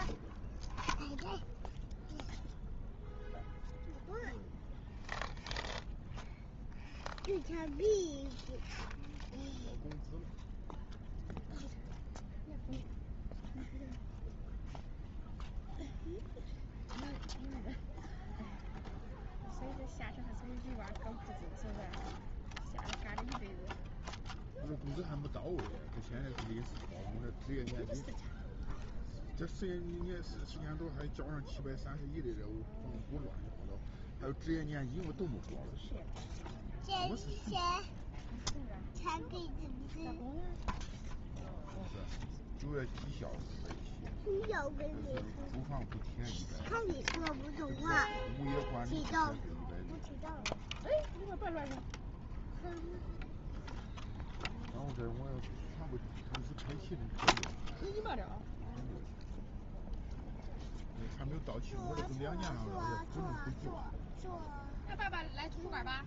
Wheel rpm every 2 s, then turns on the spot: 0, 0, 0, 0, 0, 0, 0, 0, 0, 0, 0, 0, 0, 0, 0, 0, 0, 0, 0, 0, 0, 0, 0, 0, 0, 0, 0, 0, 0, 0, 0, 0, 0.
none